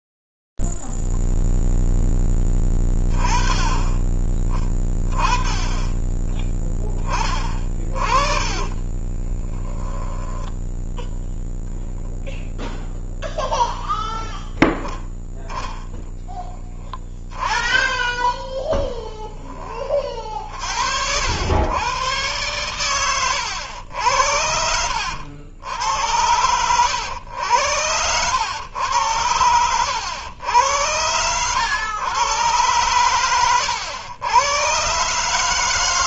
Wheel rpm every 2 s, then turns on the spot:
20, 10, 20, 10, 30, 10, 10, 0, 10, 10, 50, 120, 90, 90, 100, 100, 110, 110.
8-10